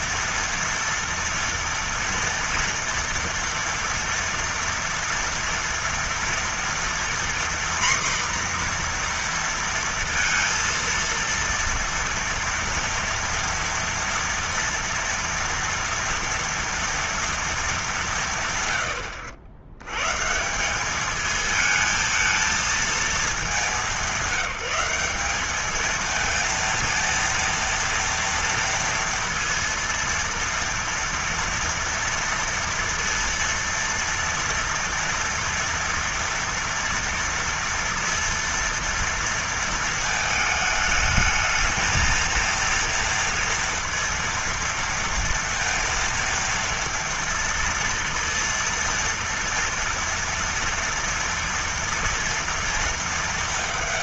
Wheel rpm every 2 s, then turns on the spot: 230, 230, 230, 240, 240, 230, 230, 230, 230, 140, 150, 220, 190, 230, 230, 230, 230, 230, 240, 230, 220, 230, 230, 230, 230, 230, 230.
none